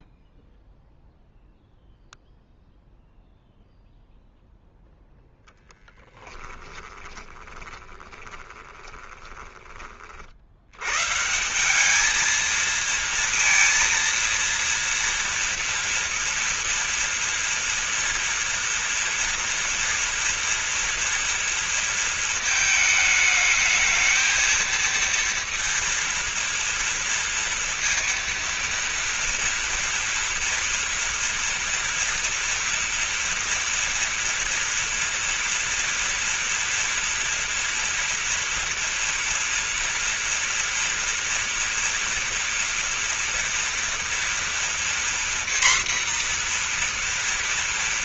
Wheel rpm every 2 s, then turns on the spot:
0, 0, 0, 10, 20, 100, 220, 230, 230, 230, 230, 220, 230, 230, 230, 230, 230, 230, 230, 230, 230, 230, 240, 240.
6-10